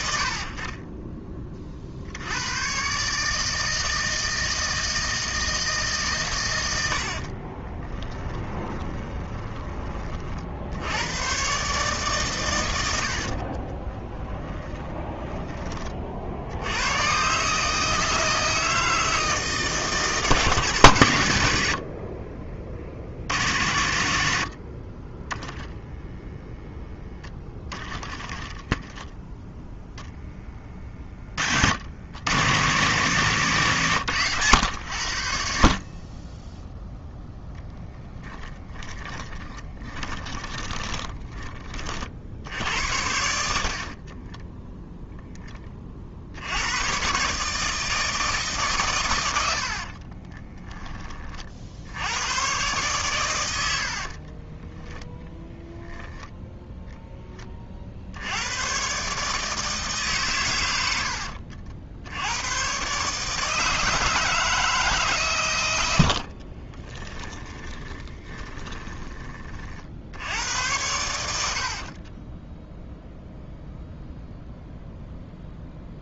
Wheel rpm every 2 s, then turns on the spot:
60, 120, 160, 90, 20, 70, 100, 20, 90, 160, 140, 60, 50, 0, 10, 20, 130, 100, 0, 10, 20, 70, 0, 110, 140, 10, 120, 10, 0, 110, 110, 120, 160, 30, 20, 90, 0, 0.
8-10 14-16 30-32 38-42 54-56 66-70